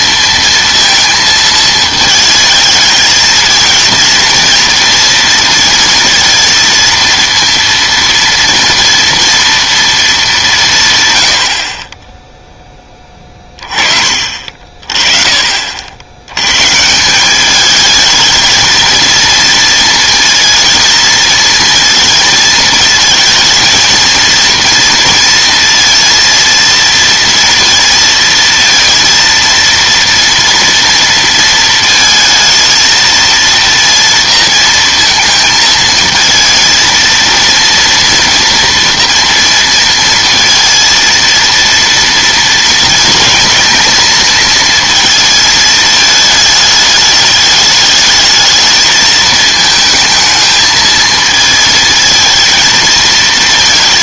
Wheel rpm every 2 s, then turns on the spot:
230, 220, 230, 230, 230, 170, 10, 40, 140, 220, 230, 220, 230, 230, 230, 230, 220, 230, 230, 230, 230, 230, 230, 210, 220, 220, 220.
none